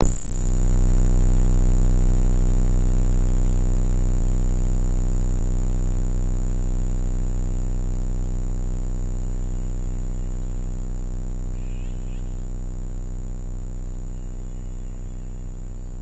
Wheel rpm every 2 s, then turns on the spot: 0, 0, 0, 0, 0, 0, 0, 0.
none